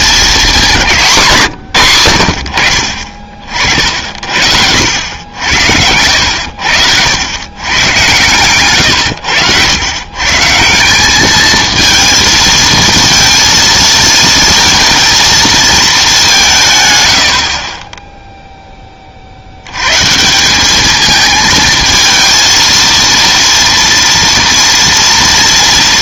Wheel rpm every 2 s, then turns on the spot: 200, 50, 70, 80, 120, 170, 230, 220, 160, 10, 200, 230, 230.
none